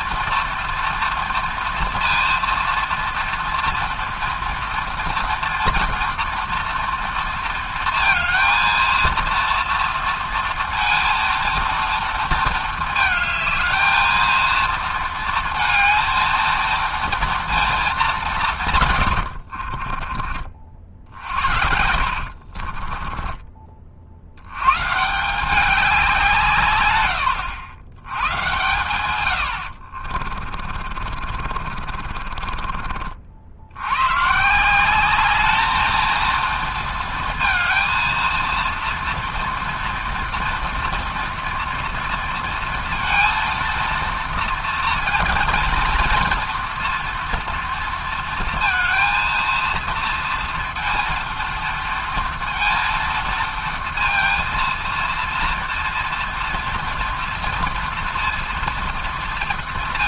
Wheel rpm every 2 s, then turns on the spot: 240, 230, 230, 240, 220, 230, 230, 230, 230, 160, 40, 50, 110, 150, 110, 20, 20, 160, 230, 230, 240, 230, 230, 230, 230, 230, 230, 230, 230, 230.
22-24 30-34